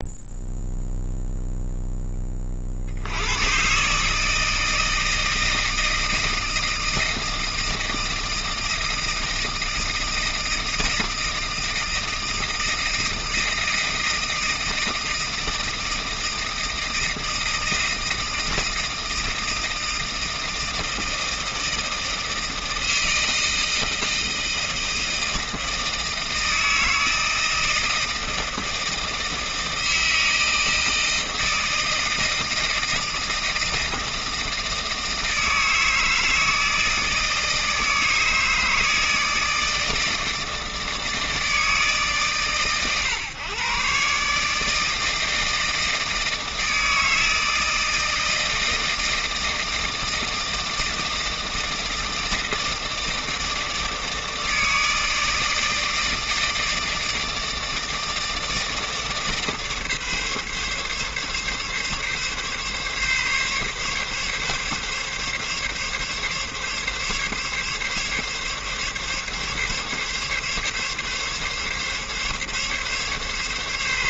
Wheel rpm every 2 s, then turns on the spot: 0, 20, 150, 160, 160, 160, 160, 160, 160, 160, 160, 160, 160, 160, 160, 160, 160, 160, 160, 160, 160, 130, 140, 160, 160, 160, 160, 160, 160, 160, 140, 140, 140, 140, 140, 140, 140.
none